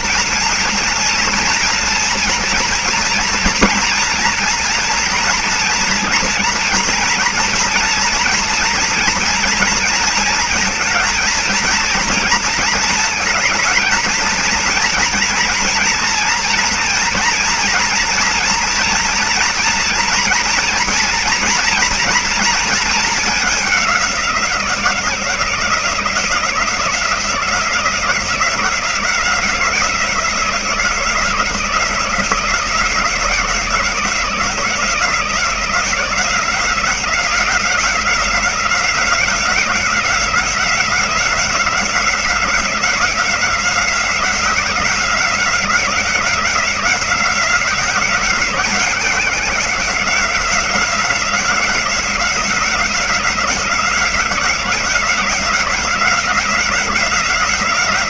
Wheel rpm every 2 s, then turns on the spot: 230, 230, 240, 230, 230, 230, 230, 230, 230, 230, 230, 230, 180, 170, 170, 170, 170, 170, 180, 180, 180, 180, 180, 180, 190, 180, 180, 180, 180.
none